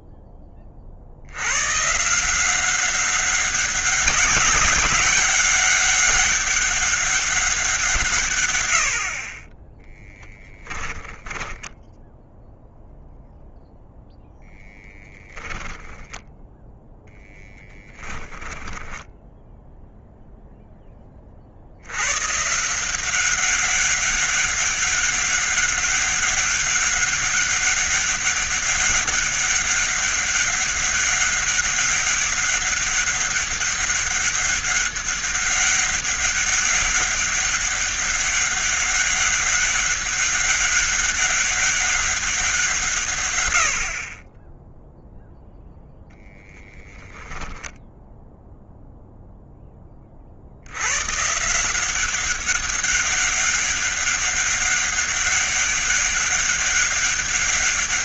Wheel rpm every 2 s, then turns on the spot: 40, 190, 200, 200, 70, 10, 0, 0, 0, 10, 10, 170, 200, 200, 200, 200, 200, 200, 200, 200, 200, 160, 0, 10, 0, 90, 200, 200, 200.
18-20